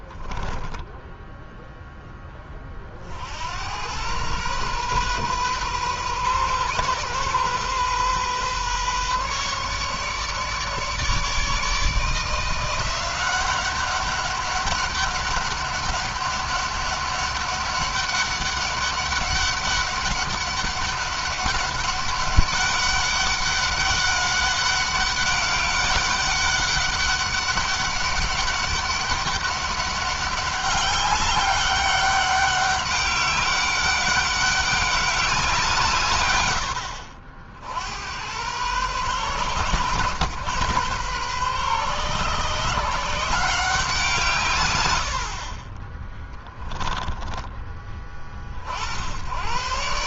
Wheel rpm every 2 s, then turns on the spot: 10, 40, 120, 130, 140, 150, 170, 200, 200, 200, 200, 200, 200, 200, 200, 200, 200, 200, 80, 120, 120, 150, 90, 10, 60.
0-2 46-48